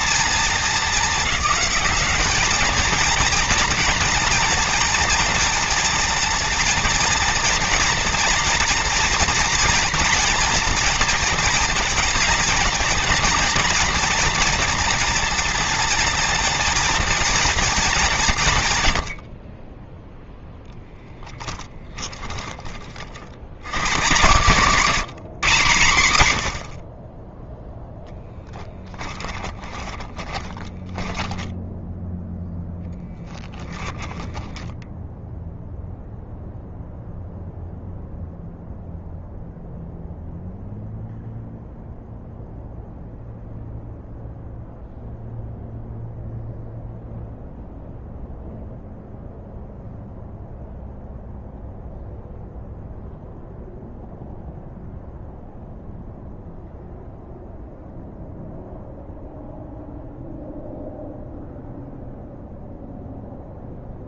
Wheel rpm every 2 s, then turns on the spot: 210, 220, 230, 230, 230, 230, 220, 230, 230, 90, 10, 50, 180, 40, 20, 10, 10, 0, 0, 0, 0, 0, 0, 0, 0, 0, 0, 0, 0, 0, 0, 0.
20-22 28-34